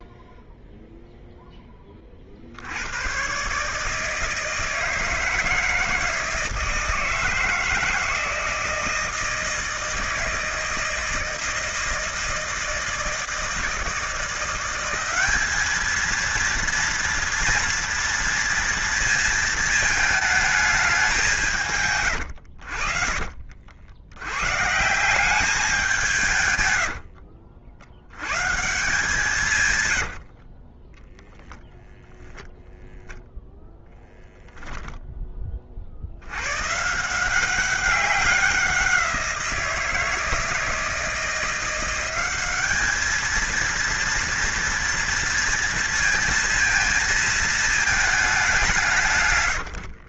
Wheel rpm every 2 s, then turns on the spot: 0, 70, 160, 160, 160, 160, 160, 170, 230, 230, 210, 80, 130, 110, 130, 40, 0, 0, 120, 190, 160, 200, 240, 230, 190.
26-28 30-32